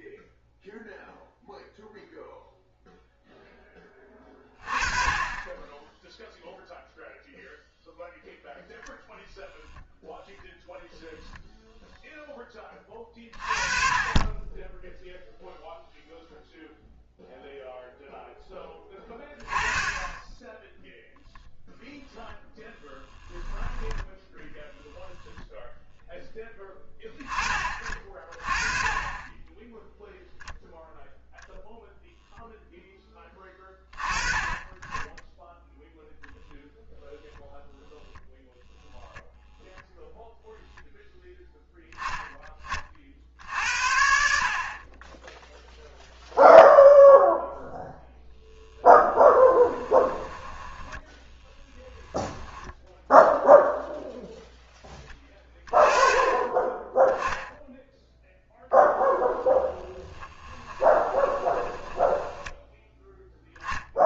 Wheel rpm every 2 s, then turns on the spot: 0, 0, 20, 0, 0, 0, 20, 10, 0, 10, 0, 10, 10, 10, 30, 0, 0, 20, 0, 0, 0, 30, 50, 0, 0, 10, 10, 10, 20, 10, 10, 10.
50-52 60-64